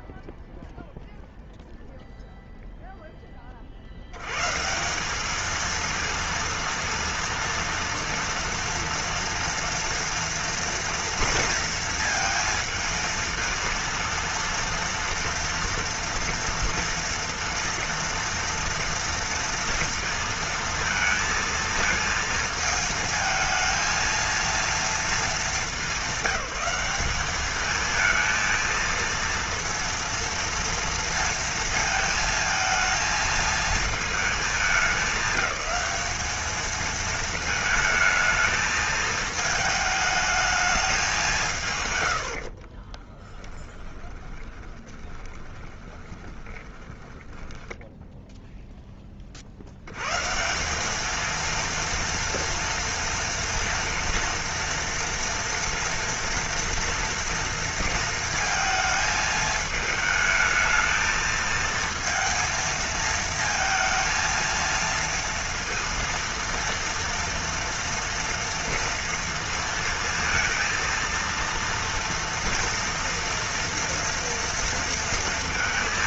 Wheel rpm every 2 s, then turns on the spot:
0, 10, 210, 230, 230, 230, 220, 240, 230, 230, 230, 220, 220, 200, 230, 230, 220, 210, 220, 220, 220, 40, 20, 20, 0, 180, 230, 230, 230, 230, 220, 230, 230, 230, 230, 230, 230, 230.
42-48